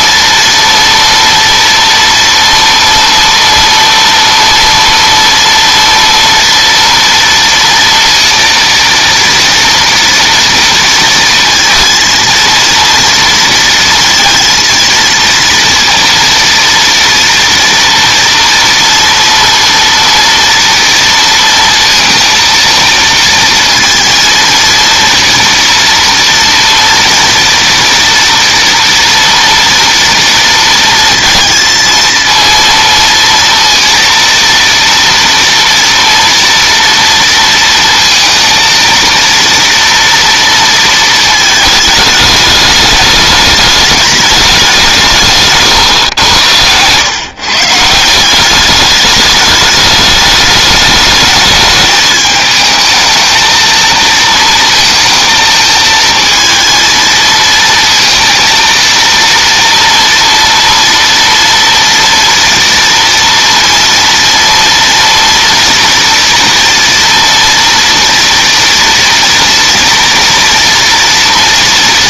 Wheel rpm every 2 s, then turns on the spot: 230, 230, 230, 230, 230, 230, 230, 230, 230, 230, 230, 230, 230, 230, 230, 230, 230, 230, 230, 230, 230, 210, 210, 120, 170, 210, 220, 230, 220, 230, 230, 230, 230, 230, 240, 240.
46-48